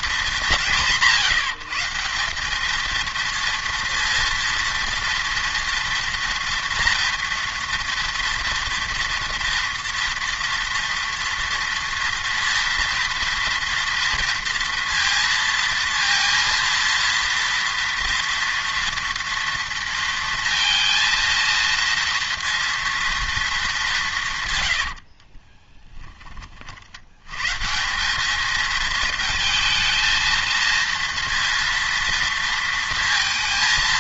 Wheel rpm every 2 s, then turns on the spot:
180, 220, 230, 240, 230, 230, 230, 230, 230, 230, 230, 230, 100, 40, 220, 230, 230.
24-26